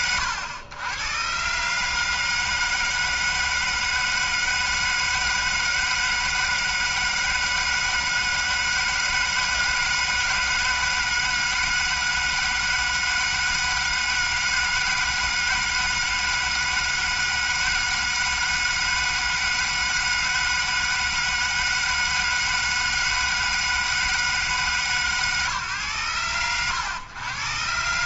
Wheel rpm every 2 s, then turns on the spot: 110, 160, 160, 160, 160, 160, 160, 160, 160, 160, 160, 160, 150, 100.
none